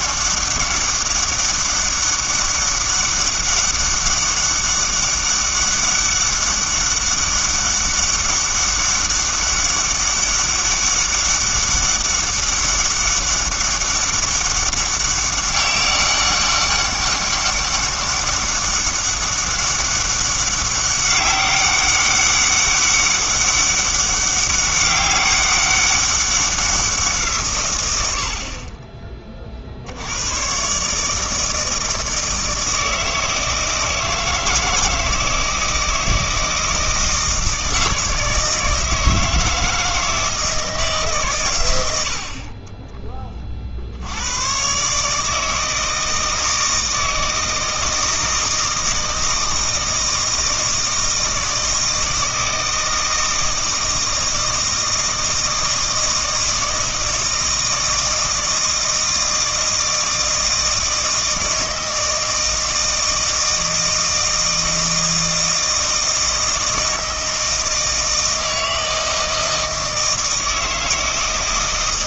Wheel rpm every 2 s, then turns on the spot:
200, 200, 200, 200, 200, 200, 200, 200, 200, 200, 200, 200, 200, 190, 40, 130, 160, 160, 160, 160, 160, 30, 120, 160, 160, 160, 160, 160, 160, 160, 160, 160, 160, 160, 160, 160.
none